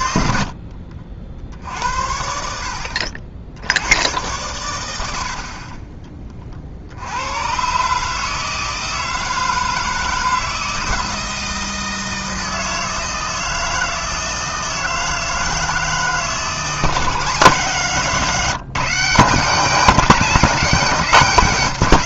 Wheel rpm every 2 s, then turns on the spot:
50, 70, 100, 60, 160, 160, 160, 160, 160, 170, 200.
0-2